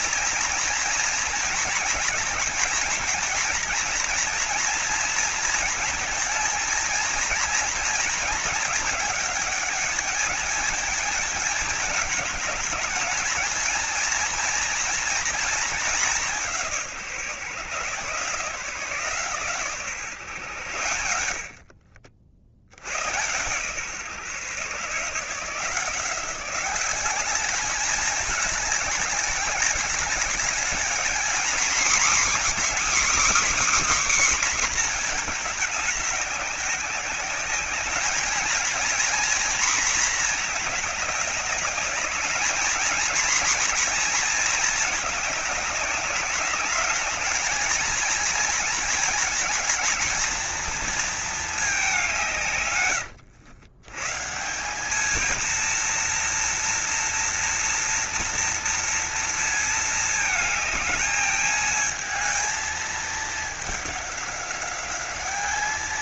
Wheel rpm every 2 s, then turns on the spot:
230, 220, 230, 230, 220, 220, 210, 230, 170, 160, 100, 80, 140, 190, 210, 210, 260, 260, 200, 230, 210, 220, 210, 210, 230, 230, 120, 200, 230, 230, 220, 220, 200.
none